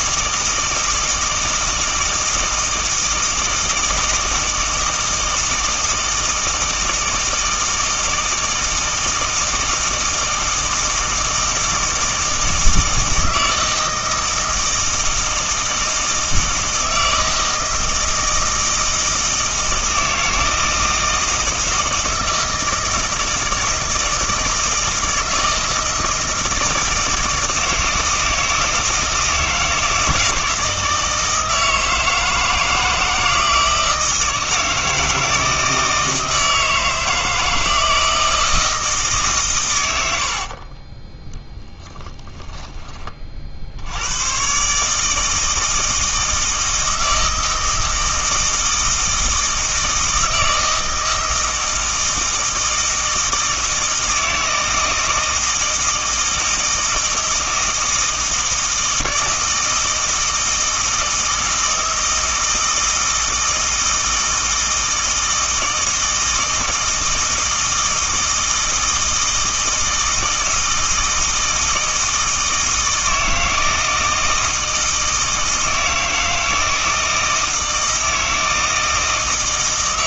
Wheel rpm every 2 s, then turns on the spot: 160, 160, 160, 160, 160, 160, 160, 160, 160, 160, 160, 160, 160, 160, 160, 160, 160, 160, 160, 160, 30, 10, 140, 160, 160, 160, 160, 160, 160, 160, 160, 160, 160, 160, 160, 160, 160, 160, 160, 160.
40-42